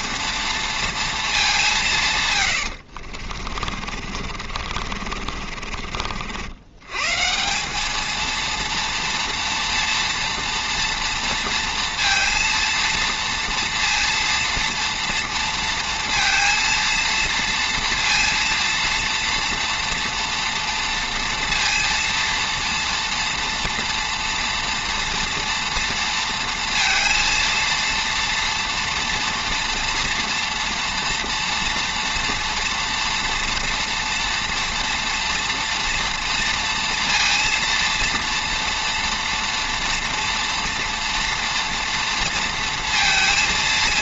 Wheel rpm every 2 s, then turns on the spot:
230, 100, 50, 100, 230, 230, 230, 230, 230, 230, 230, 230, 230, 230, 240, 230, 240, 230, 230, 230, 230, 230.
2-6